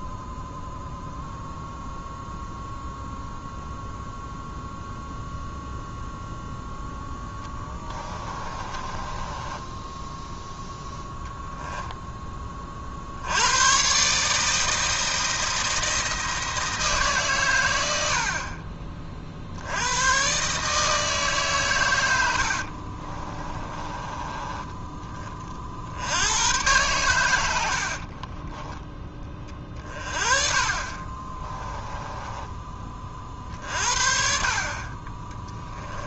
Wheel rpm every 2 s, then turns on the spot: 0, 0, 0, 0, 20, 0, 30, 160, 160, 40, 150, 60, 20, 110, 20, 40, 20, 40.
8-10 22-24